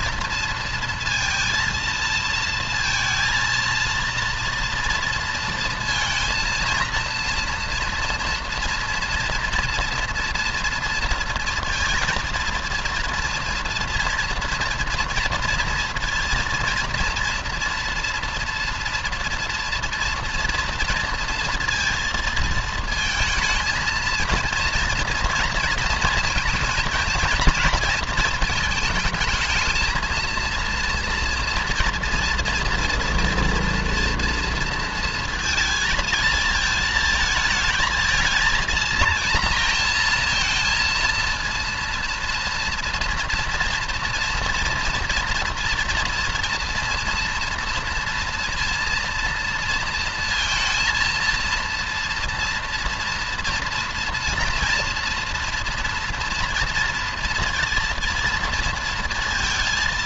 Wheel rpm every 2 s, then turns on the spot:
230, 230, 230, 230, 230, 230, 230, 240, 230, 230, 230, 220, 230, 230, 220, 230, 230, 230, 220, 230, 230, 230, 230, 230, 230, 230, 230, 230, 230, 230.
none